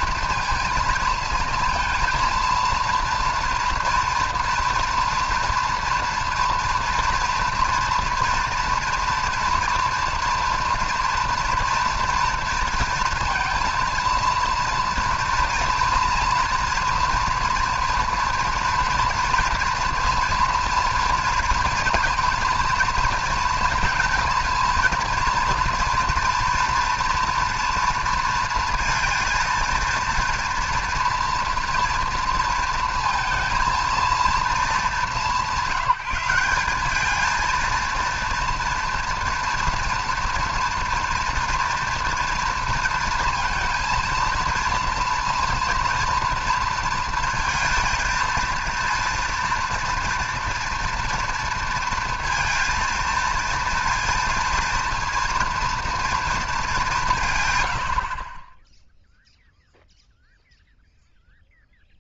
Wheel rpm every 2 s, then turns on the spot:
230, 230, 230, 230, 230, 230, 230, 230, 230, 230, 230, 230, 230, 230, 230, 230, 220, 220, 190, 230, 230, 230, 230, 230, 230, 230, 230, 230, 200, 10, 0.
none